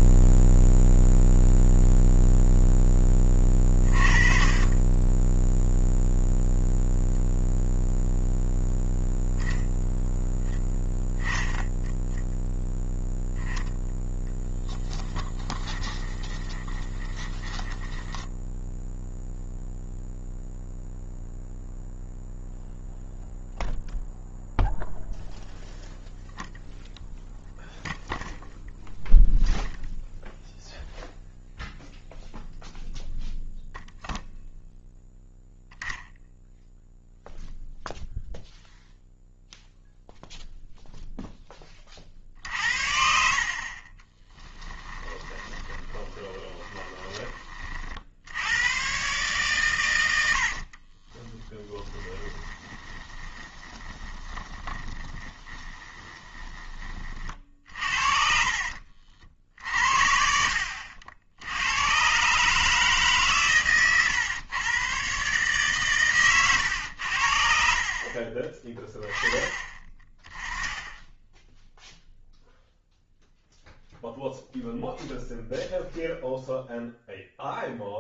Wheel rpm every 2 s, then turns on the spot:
0, 0, 30, 0, 0, 0, 0, 10, 20, 10, 0, 0, 0, 0, 0, 0, 0, 0, 0, 0, 0, 60, 10, 10, 90, 70, 20, 20, 20, 60, 70, 150, 120, 110, 20, 10, 0, 0, 0.
14-20 44-48 50-56 58-62